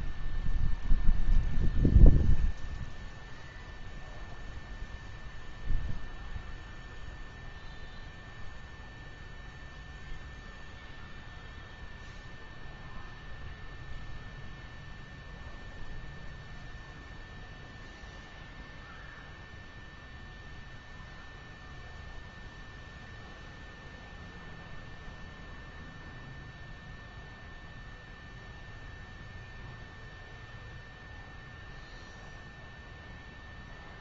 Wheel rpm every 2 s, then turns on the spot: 0, 0, 0, 0, 0, 0, 0, 0, 0, 0, 0, 0, 0, 0, 0, 0, 0.
none